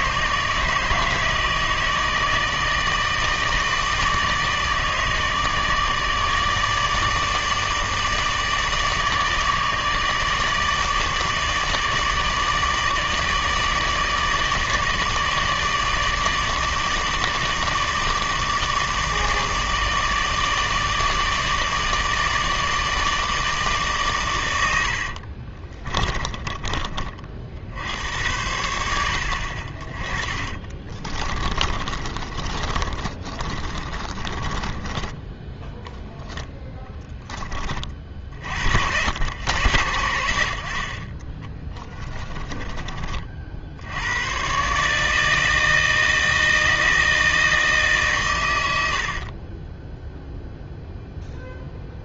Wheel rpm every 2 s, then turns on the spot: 160, 160, 160, 150, 160, 150, 150, 150, 160, 160, 150, 160, 90, 30, 90, 20, 30, 20, 10, 60, 60, 20, 140, 160, 90, 0.
26-28 30-36 48-50